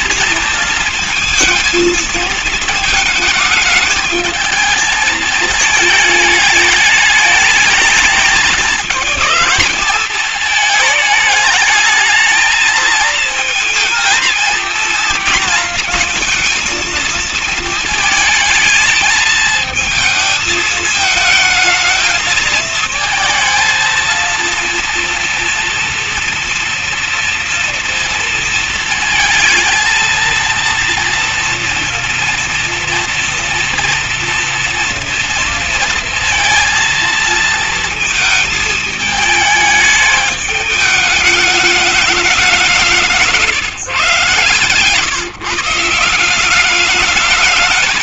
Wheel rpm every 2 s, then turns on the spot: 220, 230, 220, 220, 220, 220, 220, 230, 230, 220, 220, 220, 230, 230, 230, 230, 230, 230, 230, 220, 210, 190, 140, 180.
none